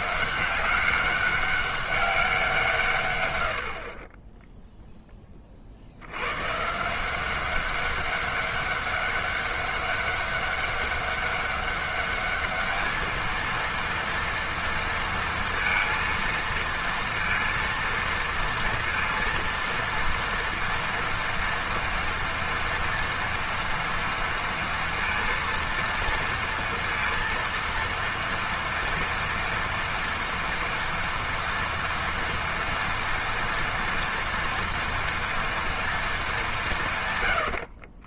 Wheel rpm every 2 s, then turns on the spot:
190, 170, 0, 140, 200, 200, 210, 230, 230, 230, 230, 230, 230, 230, 230, 230, 230, 230, 170.
none